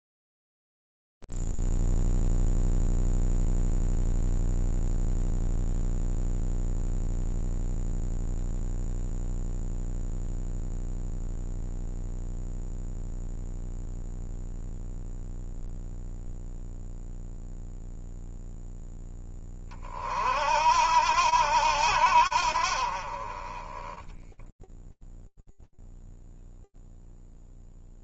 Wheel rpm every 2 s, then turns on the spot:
0, 0, 0, 0, 0, 0, 0, 0, 0, 10, 80, 20, 0, 0.
none